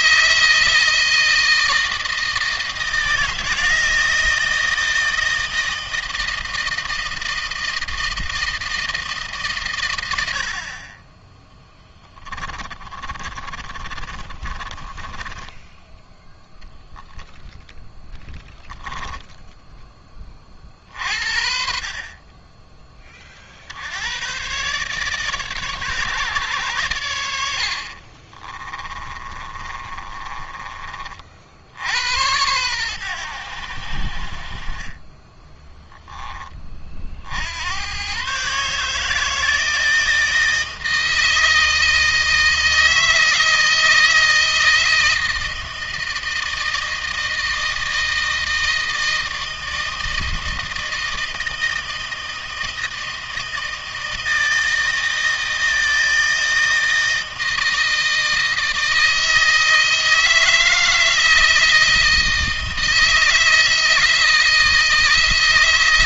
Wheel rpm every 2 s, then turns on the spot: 160, 160, 160, 160, 160, 40, 30, 30, 0, 10, 50, 30, 130, 110, 30, 30, 100, 20, 40, 150, 160, 160, 160, 160, 160, 160, 160, 160, 160, 160, 160, 160, 160.
12-16 18-20 28-30